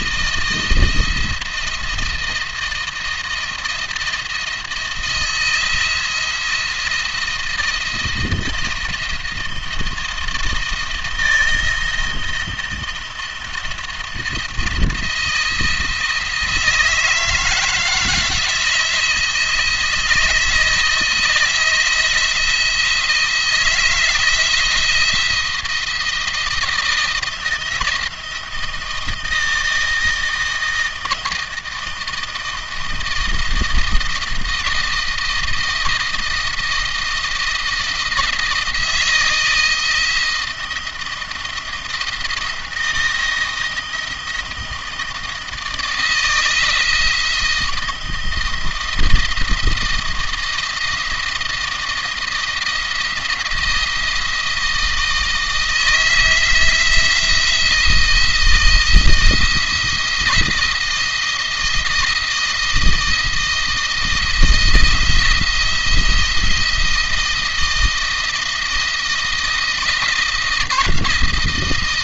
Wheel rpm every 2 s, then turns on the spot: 170, 170, 170, 170, 170, 170, 170, 170, 160, 170, 160, 170, 170, 160, 170, 160, 160, 170, 160, 160, 160, 170, 160, 160, 170, 160, 170, 160, 160, 170, 170, 170, 170, 170, 170, 170.
none